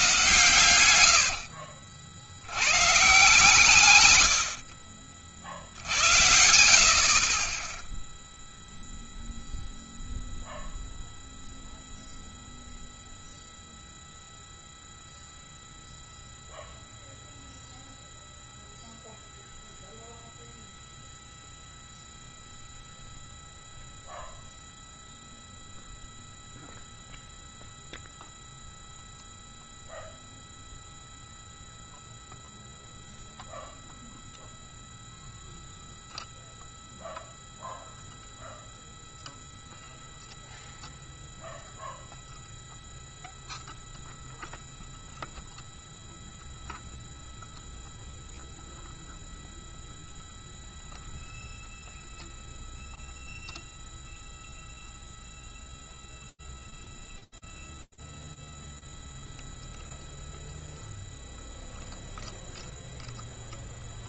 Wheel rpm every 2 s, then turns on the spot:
130, 100, 60, 70, 0, 0, 0, 0, 0, 0, 0, 0, 0, 0, 0, 0, 0, 0, 0, 0, 0, 0, 0, 0, 0, 0, 0, 0, 0, 0, 0, 0.
none